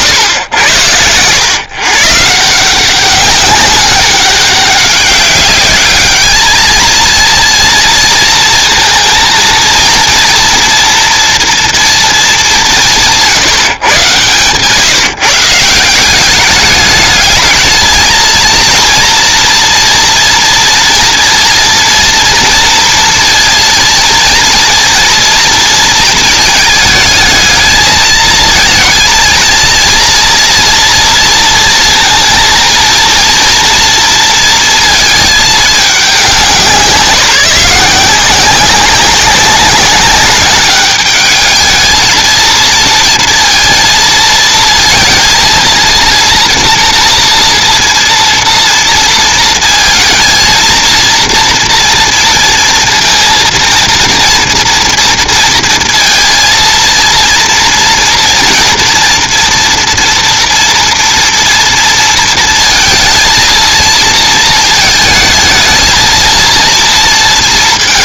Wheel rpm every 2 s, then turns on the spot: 110, 160, 200, 220, 230, 230, 190, 140, 210, 230, 230, 230, 230, 220, 220, 240, 230, 230, 180, 190, 200, 230, 220, 240, 230, 230, 230, 230, 230, 230, 230, 230, 230, 230.
none